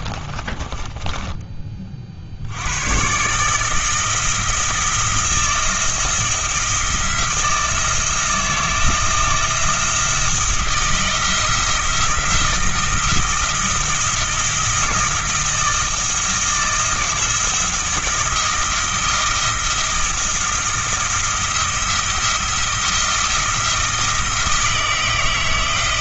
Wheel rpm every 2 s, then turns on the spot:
20, 100, 160, 170, 170, 170, 160, 170, 160, 170, 170, 170, 160.
0-2